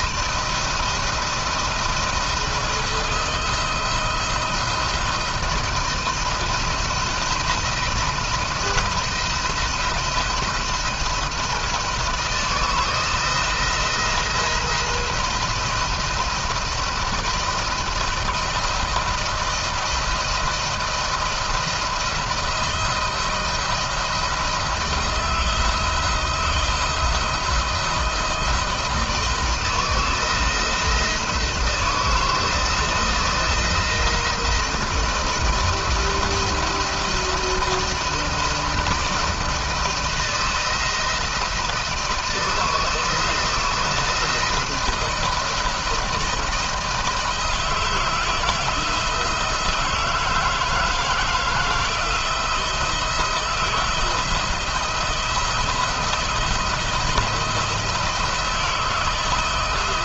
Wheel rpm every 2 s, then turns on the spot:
170, 160, 170, 170, 160, 170, 170, 170, 170, 170, 160, 170, 170, 170, 160, 160, 170, 170, 170, 170, 170, 160, 170, 160, 160, 160, 160, 160, 160, 160.
none